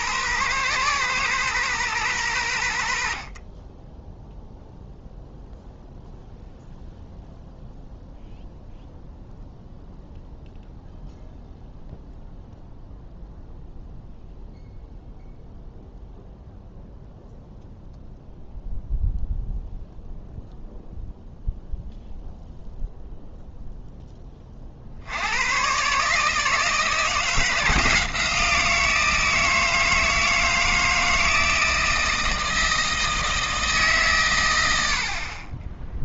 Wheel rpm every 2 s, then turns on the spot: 120, 90, 0, 0, 0, 0, 0, 0, 0, 0, 0, 0, 40, 160, 170, 160, 160, 100.
none